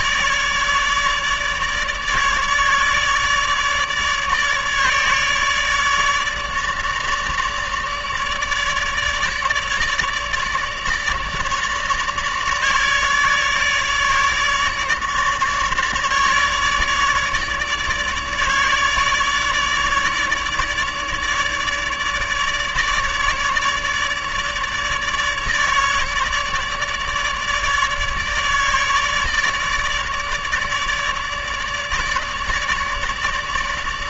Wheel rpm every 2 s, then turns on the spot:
150, 150, 150, 150, 150, 150, 150, 150, 150, 150, 150, 150, 150, 150, 150, 150, 150.
none